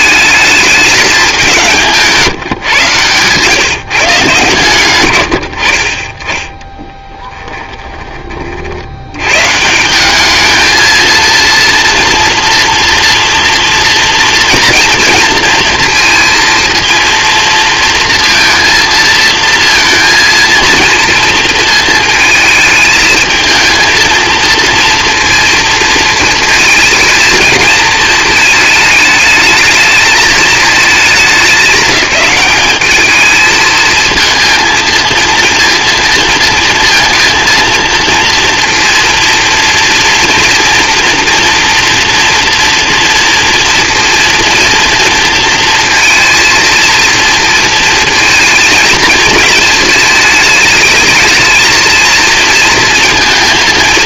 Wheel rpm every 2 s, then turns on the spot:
210, 130, 120, 10, 50, 220, 240, 230, 230, 230, 230, 220, 230, 230, 220, 220, 210, 230, 230, 230, 240, 230, 240, 230, 230, 210, 230.
none